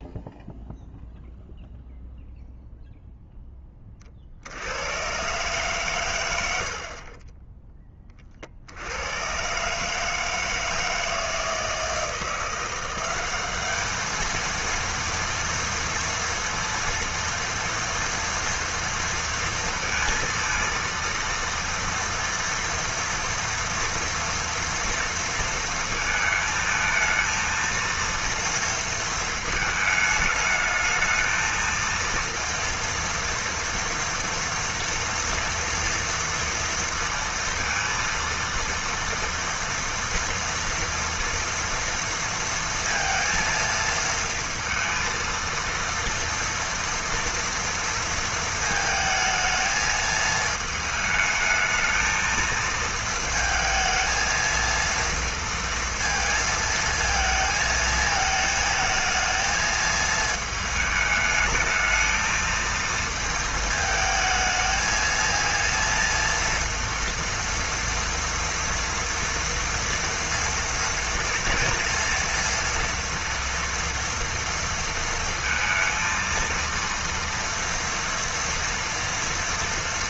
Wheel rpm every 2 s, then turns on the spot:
0, 0, 90, 50, 70, 160, 170, 230, 230, 230, 230, 230, 230, 220, 230, 210, 230, 230, 230, 230, 230, 230, 230, 230, 220, 220, 220, 230, 230, 220, 220, 220, 220, 230, 230, 230, 230, 230, 230, 230.
none